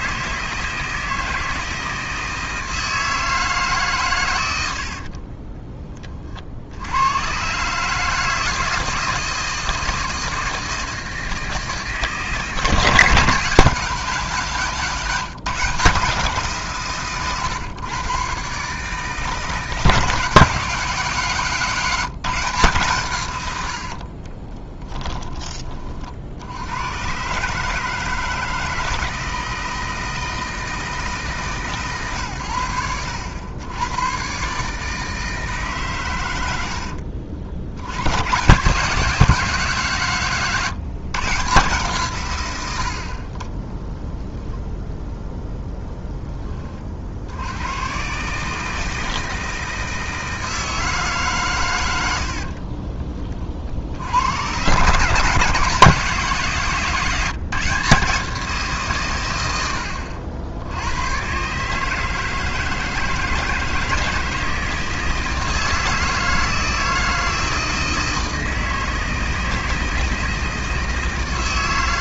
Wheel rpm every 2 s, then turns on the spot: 160, 160, 90, 70, 160, 160, 150, 170, 150, 140, 180, 160, 20, 90, 160, 160, 100, 140, 80, 160, 150, 90, 0, 30, 160, 160, 50, 130, 170, 160, 90, 160, 160, 160, 160, 160.
24-26 52-54